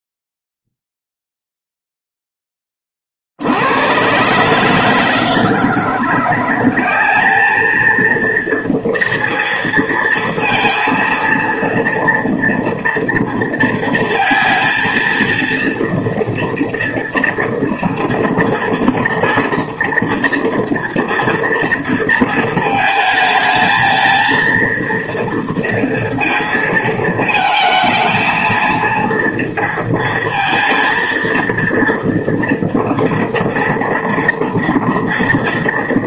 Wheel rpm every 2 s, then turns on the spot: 0, 20, 150, 190, 230, 230, 230, 230, 230, 230, 230, 220, 230, 220, 220, 230, 240, 230.
none